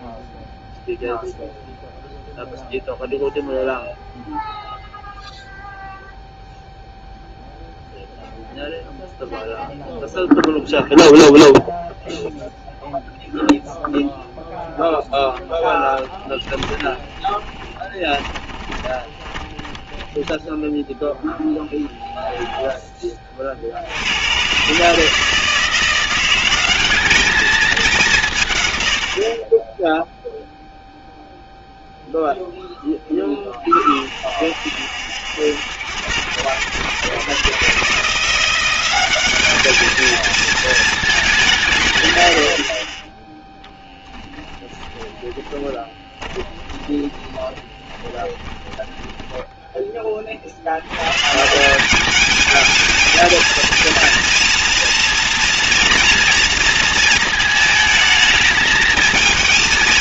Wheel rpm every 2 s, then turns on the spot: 0, 0, 0, 0, 0, 0, 0, 0, 20, 20, 10, 20, 150, 200, 100, 0, 10, 70, 120, 190, 220, 30, 10, 20, 10, 100, 220, 230, 230, 210.
16-20 44-50